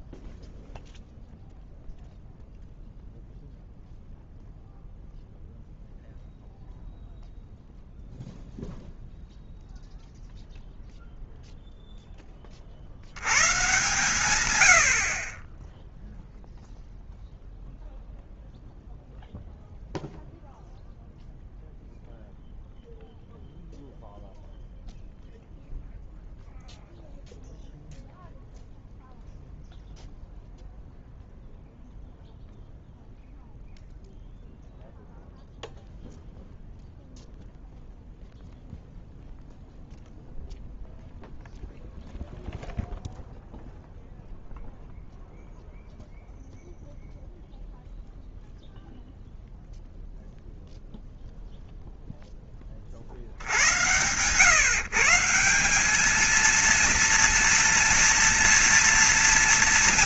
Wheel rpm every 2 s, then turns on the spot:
0, 0, 0, 0, 0, 0, 40, 110, 0, 0, 0, 0, 0, 0, 0, 0, 0, 0, 0, 0, 0, 0, 0, 0, 0, 0, 20, 140, 230, 230.
none